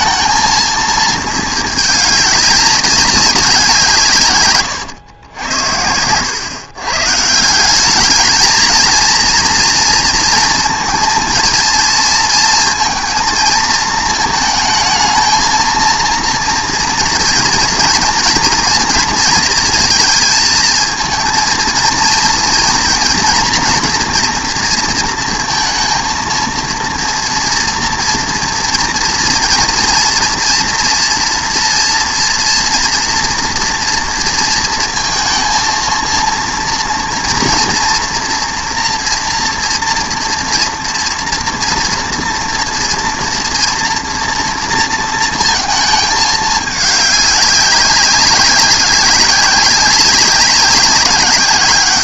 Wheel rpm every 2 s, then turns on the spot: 220, 200, 110, 130, 230, 230, 230, 220, 230, 230, 220, 230, 240, 230, 230, 230, 230, 230, 230, 230, 230, 230, 230, 210, 200, 190.
none